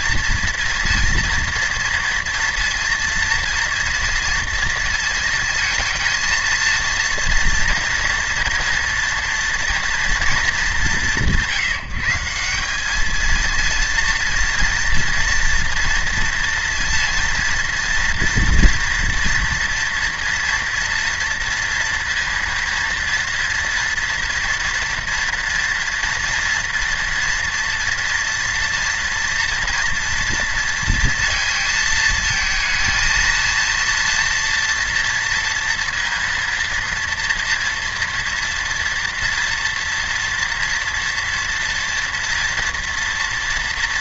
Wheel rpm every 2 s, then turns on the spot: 240, 230, 230, 230, 230, 190, 190, 230, 230, 240, 230, 230, 240, 240, 230, 230, 230, 230, 230, 230, 230, 230.
none